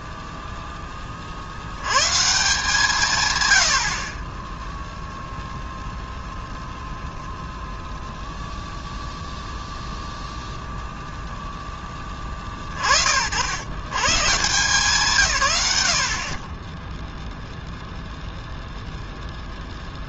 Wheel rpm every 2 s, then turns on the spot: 10, 150, 0, 0, 0, 0, 50, 160, 10, 0.
none